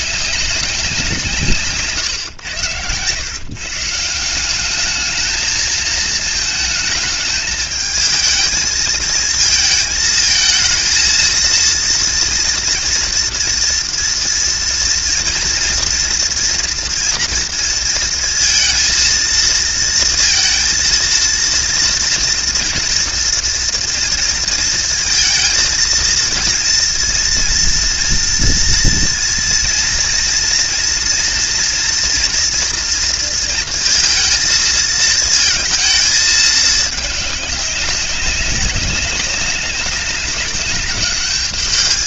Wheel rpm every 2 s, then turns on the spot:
200, 120, 210, 220, 220, 230, 230, 230, 240, 230, 230, 230, 230, 230, 230, 240, 230, 220, 210, 200, 200.
none